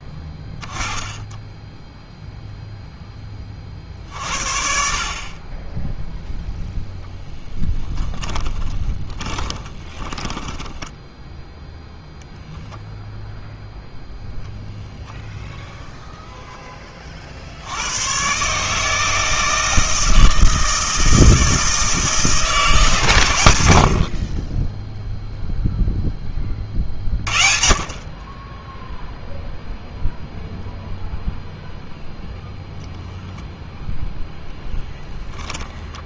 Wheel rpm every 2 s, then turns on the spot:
10, 0, 40, 0, 20, 10, 0, 0, 10, 140, 160, 170, 30, 30, 10, 0, 0, 10.
8-12